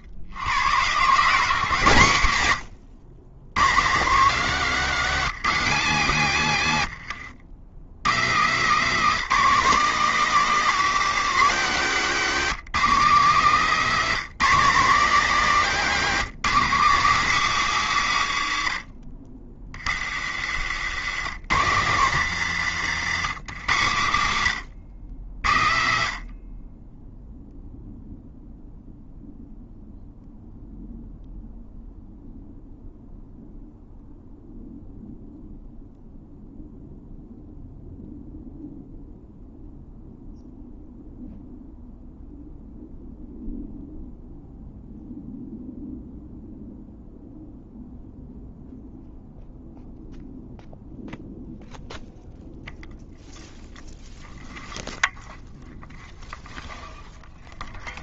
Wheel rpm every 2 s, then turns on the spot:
100, 110, 170, 130, 170, 200, 180, 180, 180, 90, 90, 120, 100, 40, 0, 0, 0, 0, 0, 0, 0, 0, 0, 0, 0, 0, 0, 0, 0.
20-22